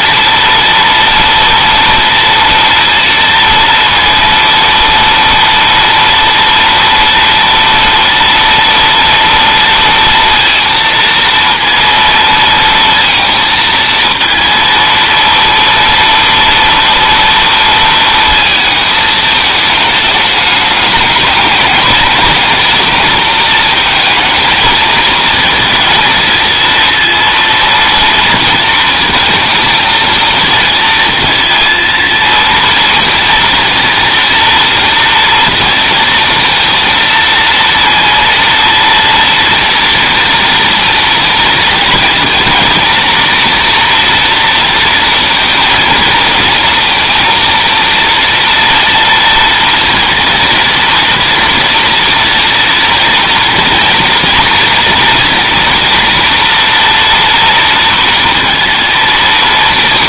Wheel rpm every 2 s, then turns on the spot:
230, 230, 230, 230, 230, 230, 230, 230, 230, 230, 210, 220, 230, 230, 230, 230, 230, 230, 230, 230, 230, 230, 230, 230, 230, 230, 230, 230, 240, 230.
none